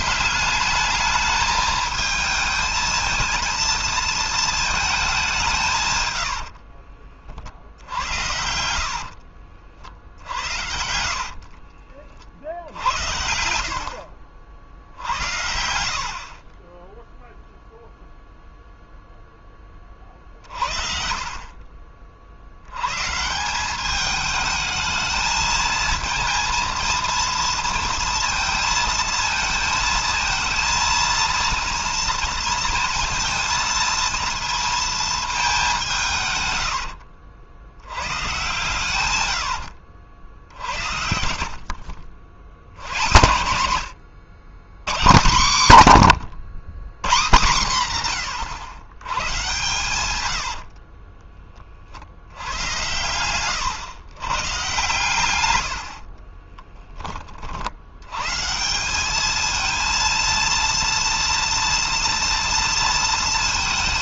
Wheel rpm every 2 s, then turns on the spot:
210, 220, 210, 50, 70, 50, 70, 60, 10, 0, 50, 140, 220, 230, 220, 230, 230, 220, 100, 130, 70, 100, 140, 150, 110, 60, 120, 130, 20, 190, 230, 230.
8-12 36-40 52-54